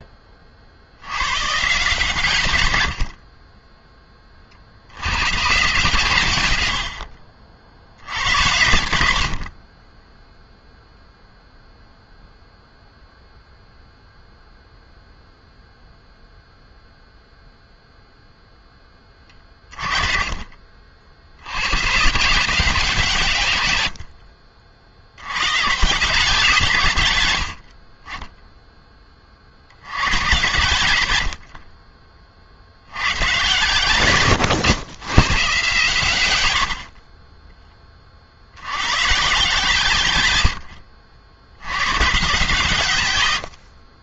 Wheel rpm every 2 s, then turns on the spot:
20, 130, 30, 120, 80, 10, 0, 0, 0, 0, 30, 150, 70, 150, 20, 120, 40, 120, 90, 40, 120, 130.
8-12 20-22 40-42